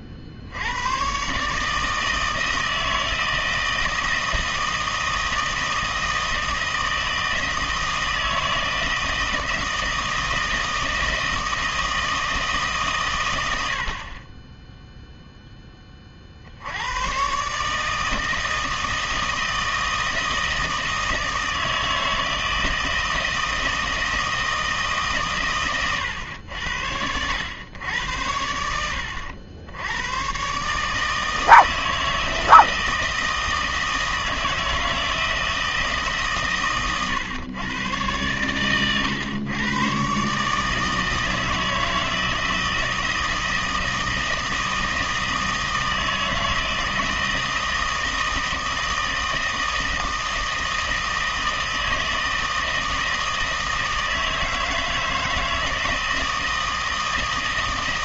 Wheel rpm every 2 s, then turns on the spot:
80, 160, 160, 160, 160, 160, 150, 10, 80, 160, 160, 160, 160, 100, 80, 140, 160, 160, 120, 110, 150, 160, 160, 160, 160, 160, 160, 160, 160.
none